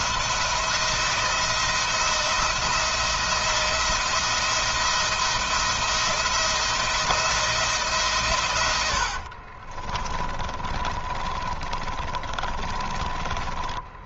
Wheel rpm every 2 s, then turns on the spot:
170, 170, 170, 170, 80, 20, 30.
8-12